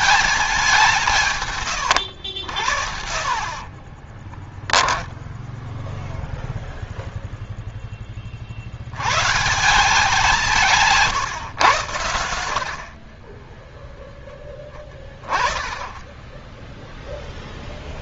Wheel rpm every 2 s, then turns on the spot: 190, 70, 20, 0, 70, 160, 70, 20, 10.
4-6